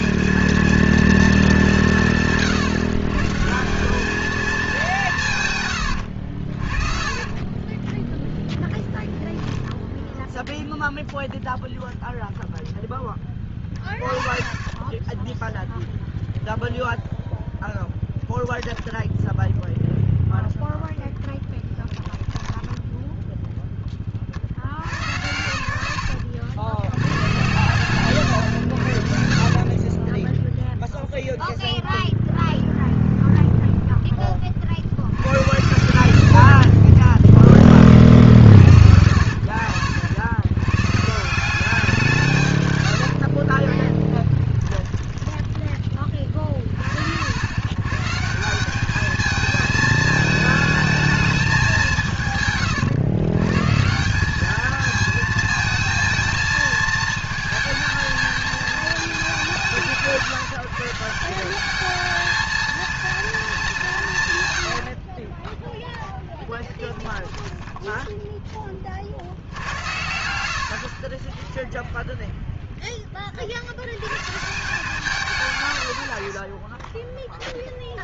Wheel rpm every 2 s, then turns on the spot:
220, 160, 210, 40, 10, 0, 0, 20, 0, 10, 0, 10, 60, 100, 100, 0, 0, 50, 50, 70, 120, 110, 20, 40, 180, 220, 140, 220, 230, 220, 150, 220, 100, 10, 20, 80, 0, 150, 20.
6-10 14-16 18-20 42-46 64-68 70-72